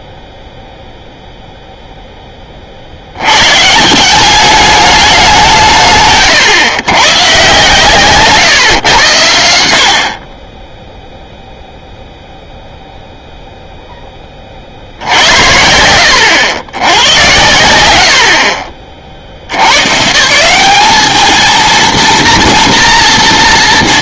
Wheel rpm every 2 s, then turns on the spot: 0, 50, 200, 120, 120, 10, 0, 60, 110, 60, 200, 240.
none